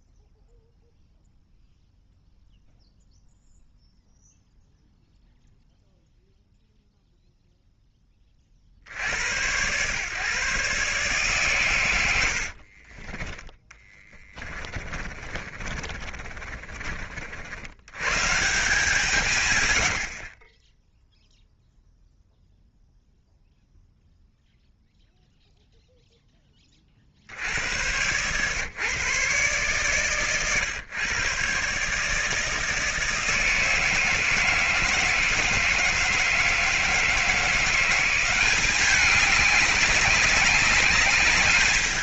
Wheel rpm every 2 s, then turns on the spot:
0, 0, 0, 0, 40, 140, 70, 20, 30, 160, 20, 0, 0, 20, 130, 130, 160, 160, 160, 190, 200.
12-18 20-22